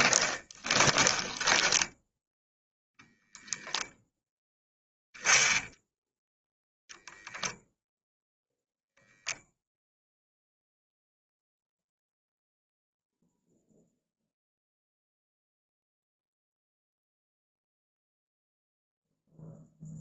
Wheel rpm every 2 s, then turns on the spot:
20, 10, 0, 0, 0, 0, 0, 0, 0, 0.
0-2